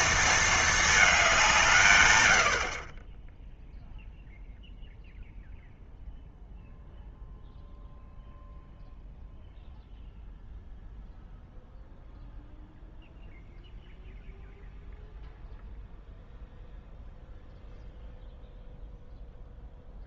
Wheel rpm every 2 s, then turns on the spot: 220, 50, 0, 0, 0, 0, 0, 0, 0, 0.
none